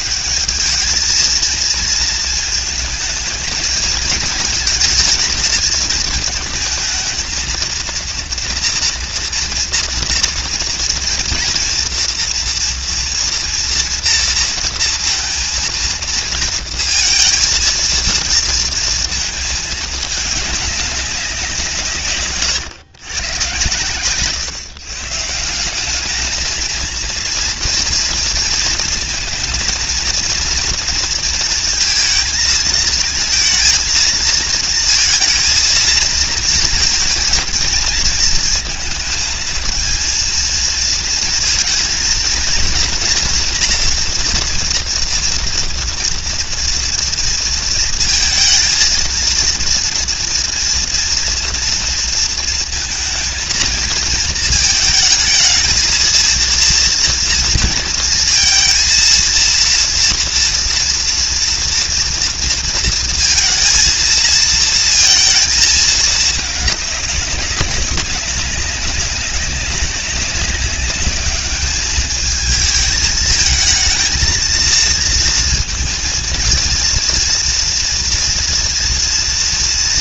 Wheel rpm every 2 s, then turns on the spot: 100, 220, 220, 230, 230, 230, 230, 230, 230, 230, 220, 150, 120, 190, 230, 230, 220, 220, 220, 220, 220, 230, 240, 230, 230, 230, 230, 230, 220, 230, 230, 230, 230, 220, 210, 190, 210, 220, 230, 230.
none